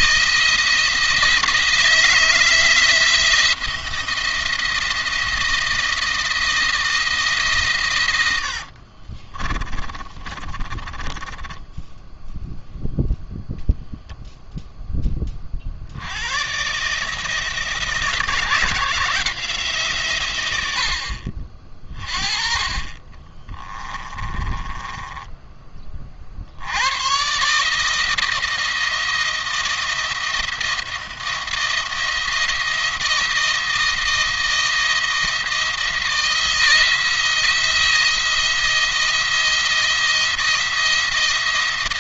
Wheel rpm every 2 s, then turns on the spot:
170, 160, 170, 160, 70, 20, 0, 0, 130, 170, 90, 30, 20, 80, 160, 170, 170, 170, 170, 170, 170.
8-12 22-26